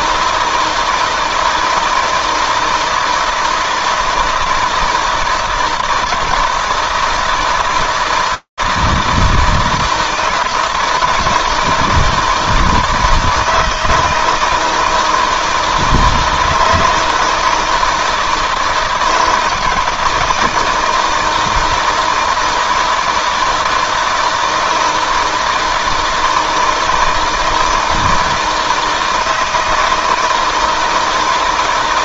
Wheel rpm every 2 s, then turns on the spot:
160, 160, 160, 160, 160, 160, 160, 160, 160, 160, 160, 160, 170, 160, 160, 160.
none